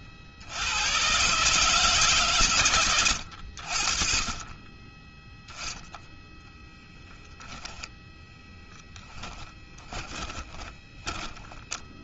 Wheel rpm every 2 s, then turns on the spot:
130, 90, 10, 0, 10, 10.
8-12